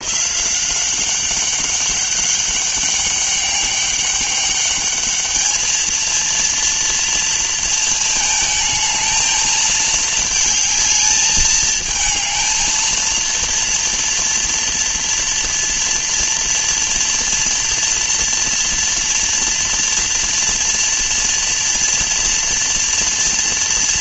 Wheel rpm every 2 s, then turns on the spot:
190, 200, 210, 230, 220, 220, 230, 230, 230, 230, 230, 230.
none